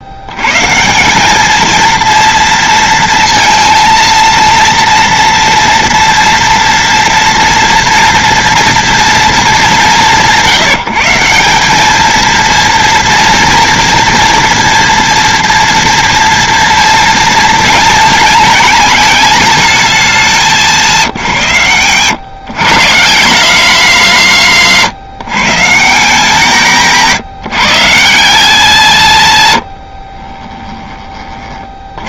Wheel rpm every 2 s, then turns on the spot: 180, 230, 230, 240, 230, 170, 230, 230, 230, 230, 170, 160, 160, 180, 170, 30.
none